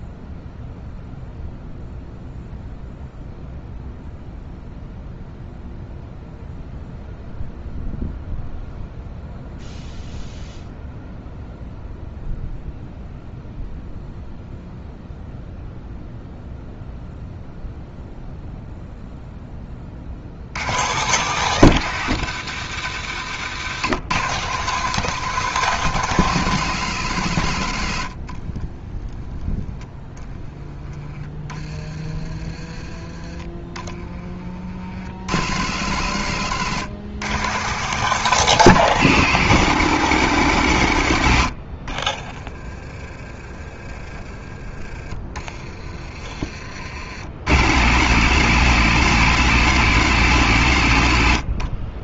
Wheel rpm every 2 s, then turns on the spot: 0, 0, 0, 0, 0, 0, 0, 0, 0, 0, 120, 100, 160, 140, 30, 20, 20, 50, 130, 170, 110, 30, 30, 50, 140, 90.
28-30 44-46